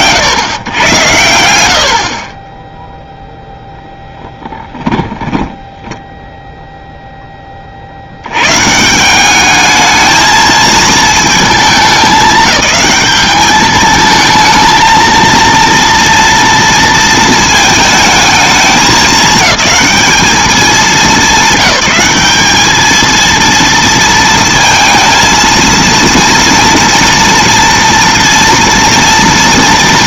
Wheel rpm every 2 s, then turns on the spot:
110, 0, 20, 0, 80, 220, 200, 220, 230, 220, 200, 190, 230, 230, 230.
4-6